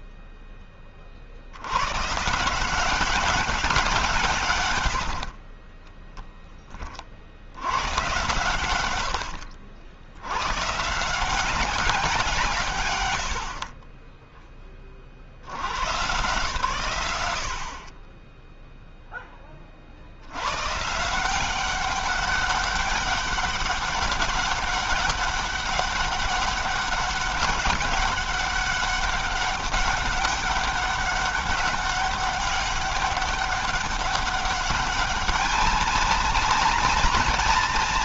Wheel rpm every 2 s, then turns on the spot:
20, 170, 110, 20, 100, 130, 120, 20, 100, 0, 120, 200, 200, 200, 200, 200, 200, 200, 230.
none